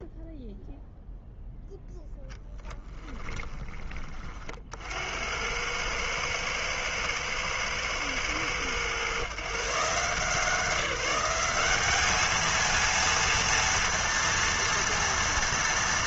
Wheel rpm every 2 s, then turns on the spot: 0, 0, 40, 110, 110, 170, 220, 230.
none